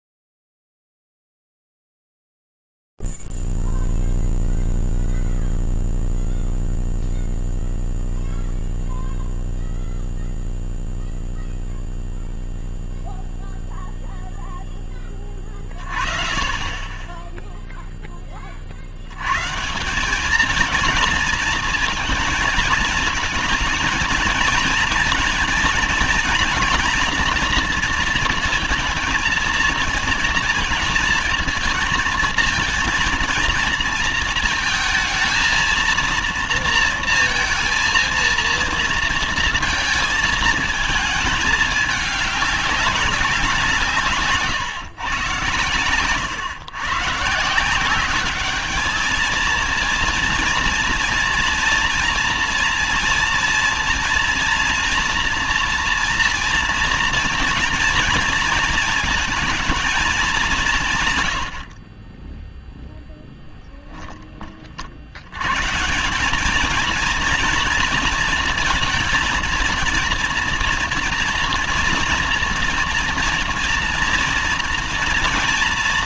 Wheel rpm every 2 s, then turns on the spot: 0, 0, 0, 0, 0, 0, 0, 0, 30, 20, 210, 220, 220, 230, 230, 230, 230, 230, 230, 230, 220, 200, 150, 130, 210, 230, 230, 240, 230, 230, 180, 10, 40, 210, 230, 230, 230, 230.
none